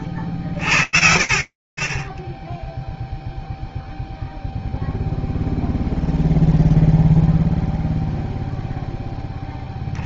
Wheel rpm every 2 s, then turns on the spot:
60, 0, 0, 0, 0.
none